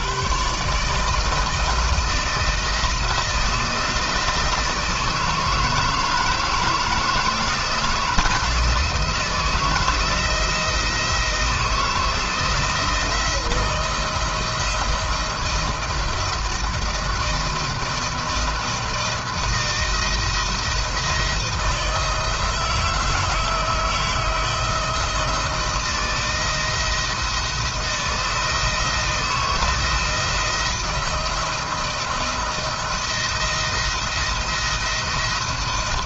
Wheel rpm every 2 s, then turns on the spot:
130, 170, 170, 160, 170, 170, 160, 170, 170, 160, 170, 160, 160, 160, 160, 170, 170, 170.
none